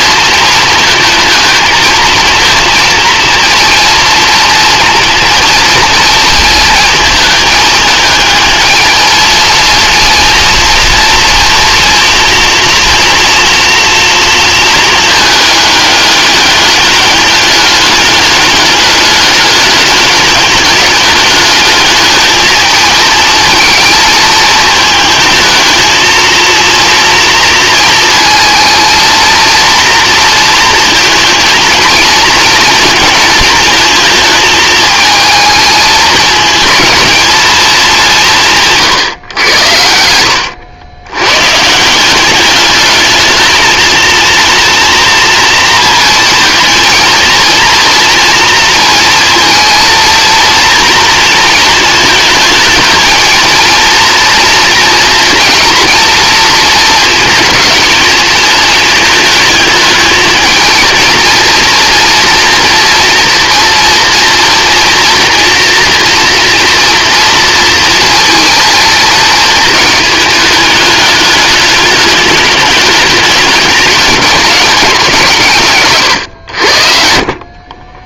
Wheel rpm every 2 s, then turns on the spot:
220, 230, 230, 220, 220, 230, 230, 220, 200, 210, 200, 220, 220, 230, 230, 230, 230, 220, 220, 140, 100, 210, 230, 230, 230, 230, 220, 230, 220, 220, 230, 240, 230, 240, 220, 210, 210, 190, 70.
none